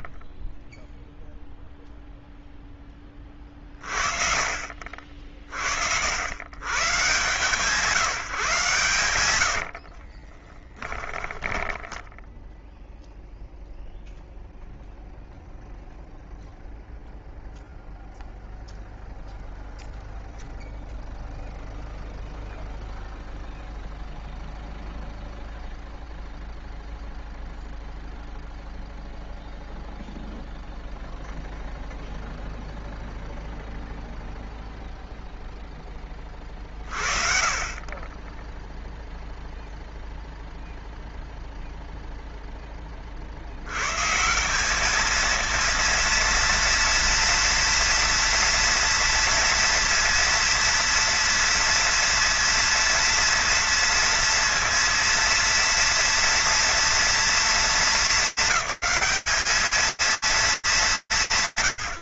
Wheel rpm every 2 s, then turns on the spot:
20, 0, 50, 110, 140, 20, 0, 0, 0, 0, 0, 0, 0, 0, 0, 0, 0, 0, 30, 0, 0, 30, 210, 230, 230, 230, 230, 230, 230, 200, 190.
10-12